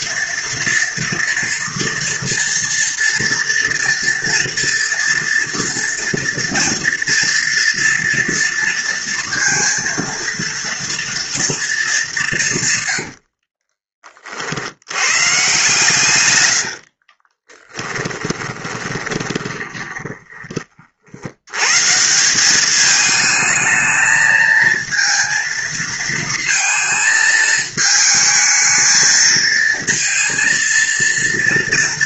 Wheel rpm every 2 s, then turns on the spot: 230, 230, 230, 230, 230, 230, 130, 80, 80, 20, 50, 210, 230, 230, 220, 230.
12-14 16-20